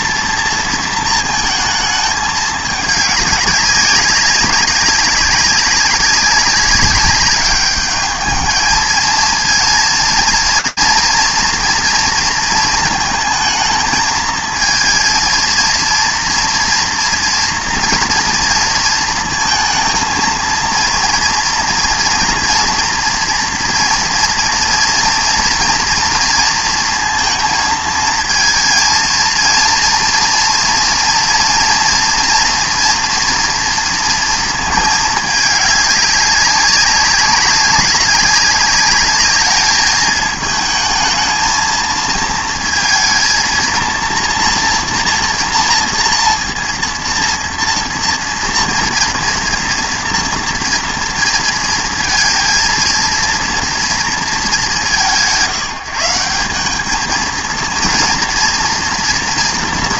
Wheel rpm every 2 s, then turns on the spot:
230, 210, 190, 190, 220, 230, 220, 220, 230, 230, 230, 230, 230, 230, 230, 230, 240, 230, 200, 200, 220, 230, 230, 230, 230, 230, 230, 190, 190, 230.
none